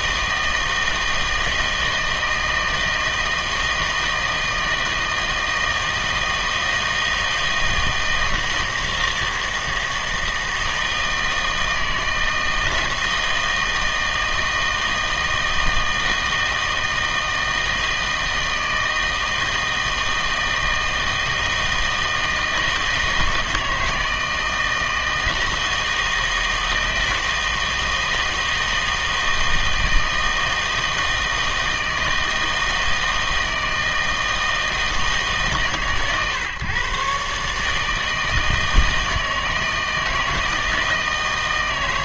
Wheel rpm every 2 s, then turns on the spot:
160, 160, 160, 160, 160, 160, 160, 160, 160, 160, 160, 160, 160, 160, 160, 160, 160, 160, 130, 160, 160.
none